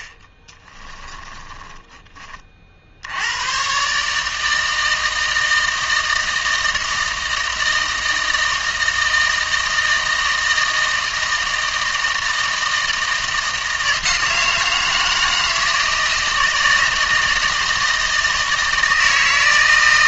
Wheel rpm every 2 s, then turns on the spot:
10, 50, 160, 160, 160, 160, 160, 160, 160, 160.
0-2